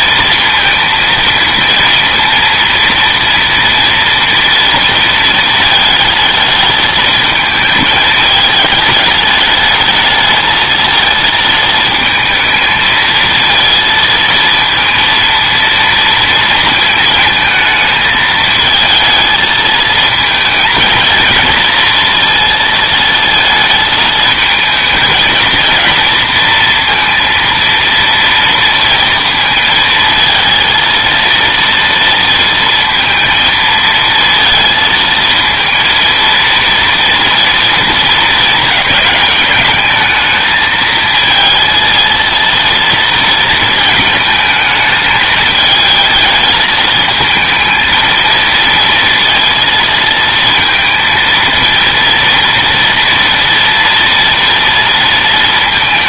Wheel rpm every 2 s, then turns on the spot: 230, 230, 230, 220, 220, 220, 220, 230, 230, 220, 220, 230, 220, 230, 230, 230, 230, 230, 230, 210, 220, 230, 220, 220, 230, 230, 230, 230.
none